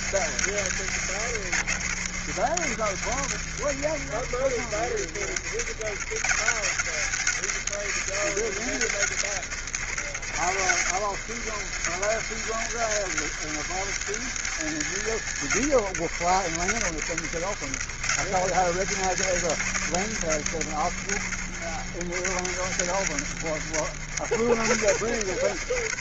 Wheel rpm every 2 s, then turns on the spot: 90, 80, 70, 90, 90, 80, 100, 100, 80, 90, 80, 80, 70.
none